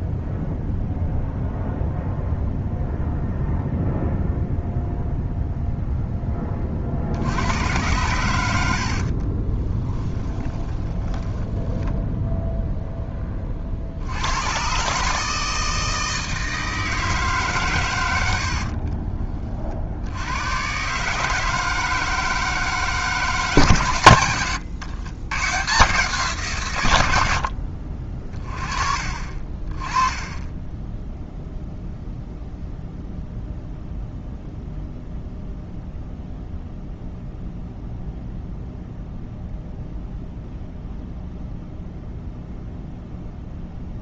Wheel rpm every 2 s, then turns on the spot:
0, 0, 0, 30, 70, 10, 0, 140, 160, 40, 130, 160, 100, 110, 40, 10, 0, 0, 0, 0, 0, 0.
8-12 18-20 30-32